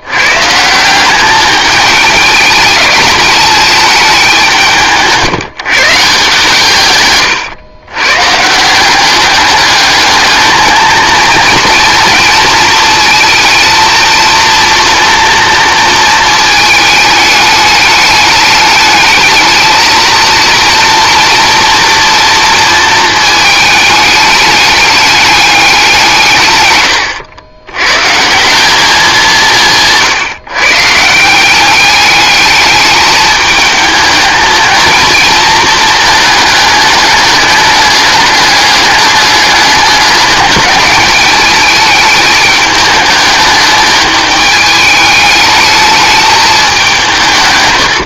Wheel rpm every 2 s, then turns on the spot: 170, 210, 160, 140, 180, 220, 230, 230, 220, 210, 230, 230, 210, 110, 190, 150, 210, 230, 210, 210, 210, 210, 210, 200.
none